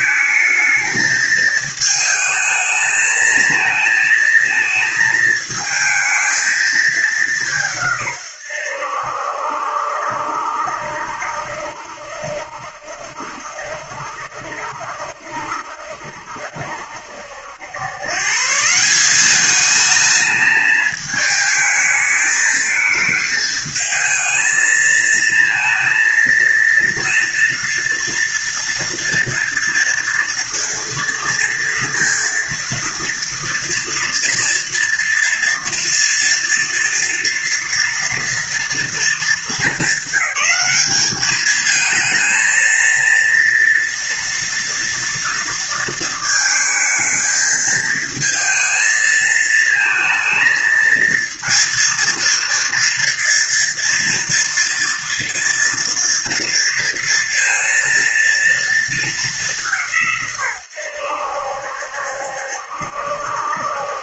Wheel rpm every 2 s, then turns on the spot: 220, 220, 220, 220, 110, 70, 70, 70, 70, 140, 220, 220, 220, 230, 230, 230, 230, 230, 230, 230, 210, 230, 240, 220, 220, 230, 230, 230, 230, 230, 130, 70.
none